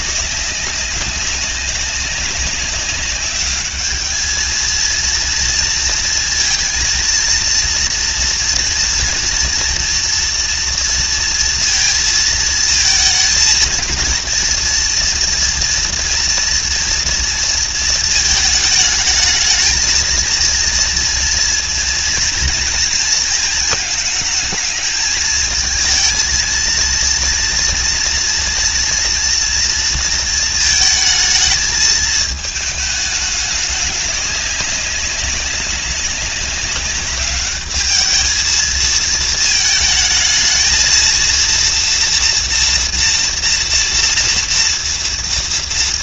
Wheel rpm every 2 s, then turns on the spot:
190, 200, 230, 230, 240, 230, 230, 240, 230, 220, 230, 230, 220, 230, 230, 220, 210, 200, 200, 220, 230, 230, 230.
none